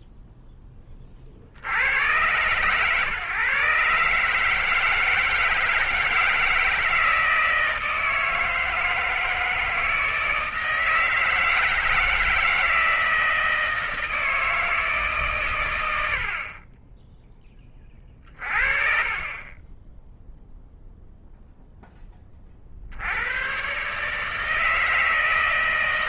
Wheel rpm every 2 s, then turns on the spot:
10, 120, 150, 160, 160, 160, 170, 160, 50, 30, 10, 30, 150.
none